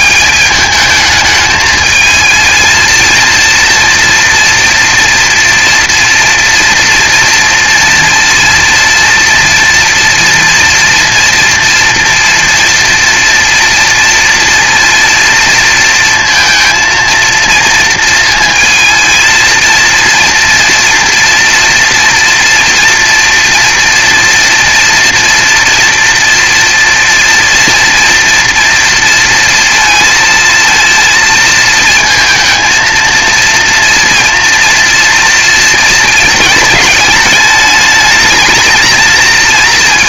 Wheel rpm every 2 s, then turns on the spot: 150, 220, 240, 240, 230, 230, 230, 230, 230, 230, 230, 230, 240, 240, 230, 230, 220, 230, 220, 210.
none